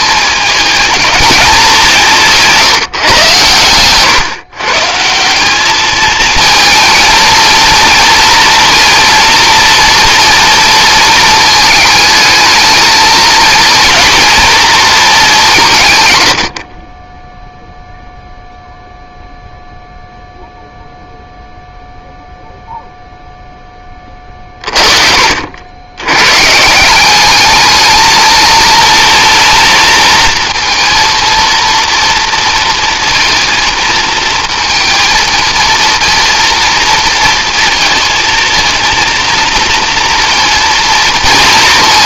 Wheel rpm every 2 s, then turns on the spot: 220, 150, 140, 220, 240, 230, 220, 230, 50, 0, 0, 0, 40, 160, 230, 230, 230, 220, 230, 220, 230.
none